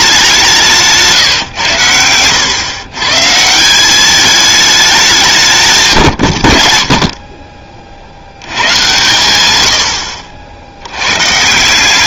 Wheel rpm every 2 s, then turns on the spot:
170, 130, 180, 50, 120, 80.
none